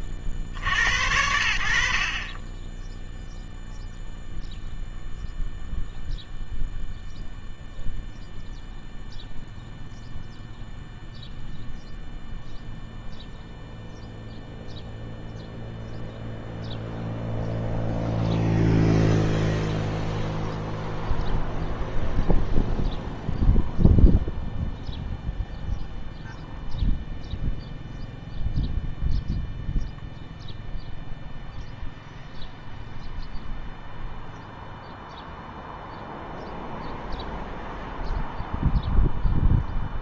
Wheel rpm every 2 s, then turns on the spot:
60, 30, 0, 0, 0, 0, 0, 0, 0, 0, 0, 0, 0, 0, 0, 0, 0, 0, 0, 0.
none